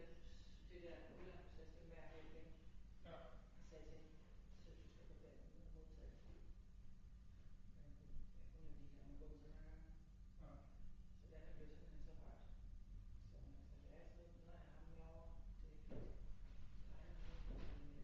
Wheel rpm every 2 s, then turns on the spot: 0, 0, 0, 0, 0, 0, 0, 0, 0.
none